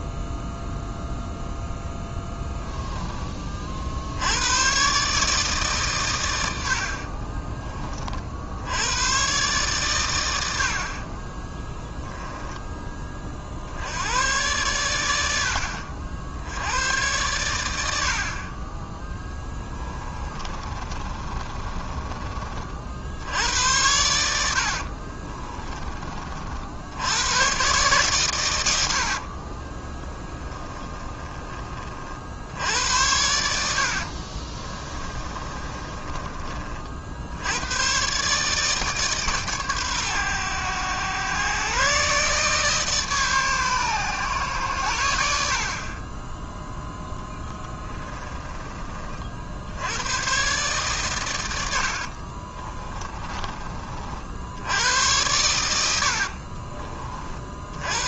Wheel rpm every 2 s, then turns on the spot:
0, 10, 140, 50, 100, 50, 20, 90, 110, 20, 30, 50, 50, 80, 70, 10, 80, 30, 80, 140, 110, 150, 90, 10, 30, 130, 30, 90, 40.
6-8 20-22 24-26 28-32 34-36 52-54